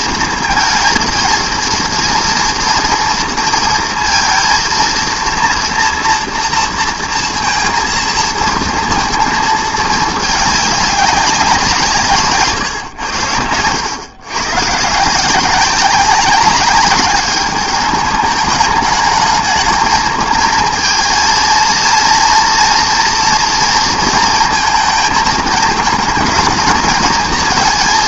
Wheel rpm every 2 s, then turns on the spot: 230, 230, 230, 230, 230, 210, 140, 140, 200, 210, 230, 230, 230, 230.
none